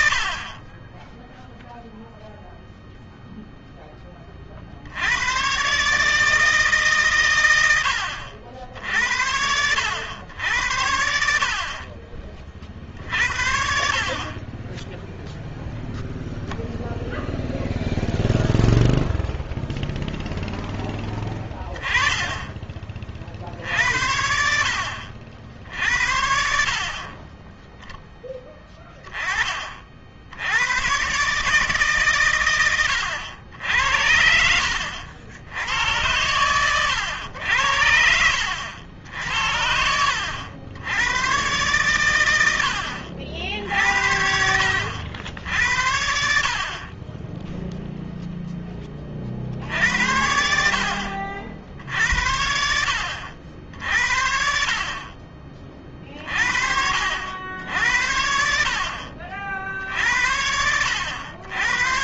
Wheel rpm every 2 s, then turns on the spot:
60, 0, 50, 150, 70, 70, 40, 30, 0, 0, 10, 30, 70, 50, 20, 100, 100, 80, 100, 70, 90, 80, 70, 40, 10, 60, 70, 40, 50, 60, 80.
none